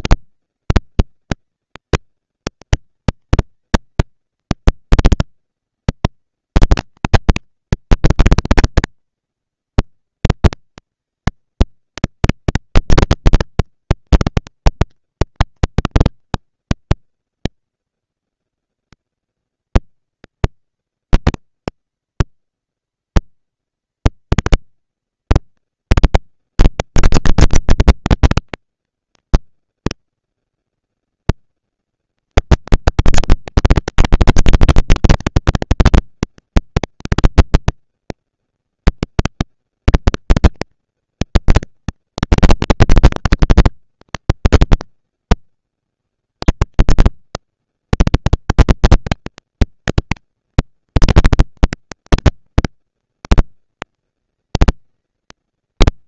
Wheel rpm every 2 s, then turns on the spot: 190, 200, 230, 230, 230, 230, 230, 230, 230, 230, 230, 230, 230, 230, 230, 230, 230, 230, 230, 230, 230, 220, 190, 110, 190, 230, 230, 220.
none